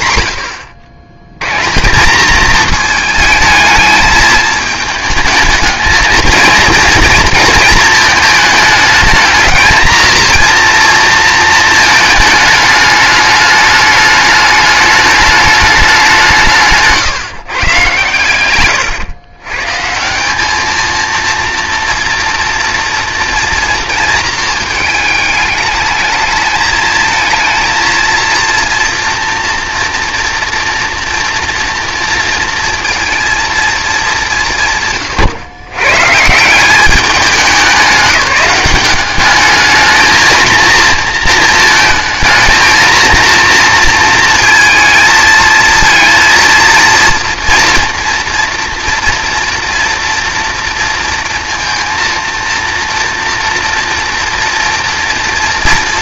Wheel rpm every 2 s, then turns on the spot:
90, 220, 220, 230, 210, 230, 210, 210, 160, 120, 220, 230, 220, 220, 230, 230, 230, 160, 180, 180, 230, 220, 230, 230, 230, 230, 230, 230.
18-20